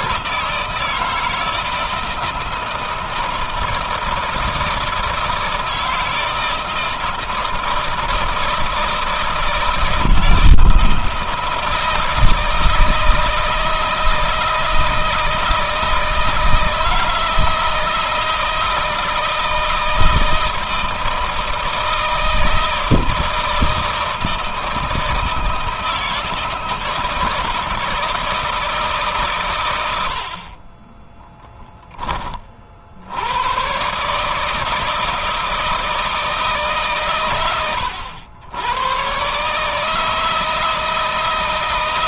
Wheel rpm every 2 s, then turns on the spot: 160, 160, 160, 160, 160, 160, 160, 160, 160, 160, 160, 160, 160, 160, 140, 20, 80, 160, 130, 120, 160.
30-32